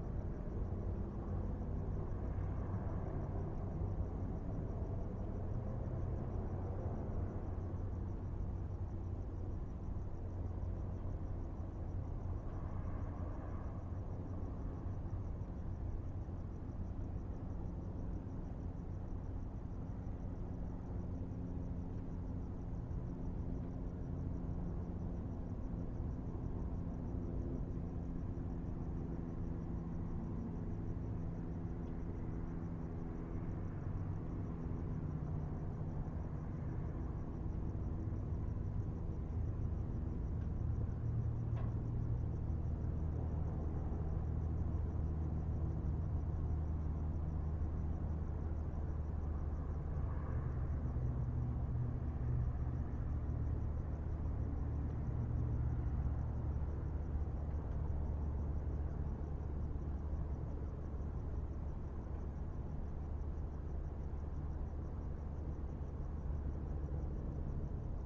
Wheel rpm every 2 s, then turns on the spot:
0, 0, 0, 0, 0, 0, 0, 0, 0, 0, 0, 0, 0, 0, 0, 0, 0, 0, 0, 0, 0, 0, 0, 0, 0, 0, 0, 0, 0, 0, 0, 0, 0, 0.
none